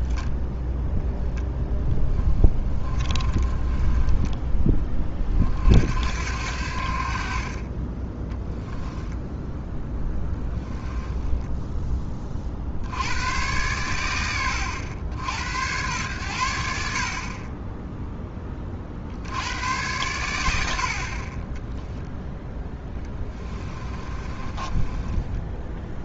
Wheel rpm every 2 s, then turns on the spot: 0, 20, 30, 40, 20, 10, 90, 90, 40, 70, 40, 20, 10.
2-4 8-12 22-26